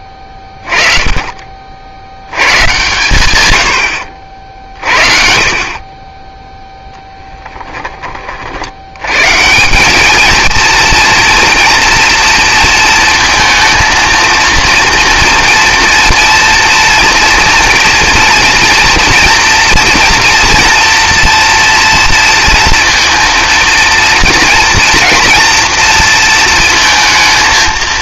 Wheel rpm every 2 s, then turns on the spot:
20, 120, 40, 0, 70, 220, 230, 230, 240, 230, 230, 230, 230, 230.
none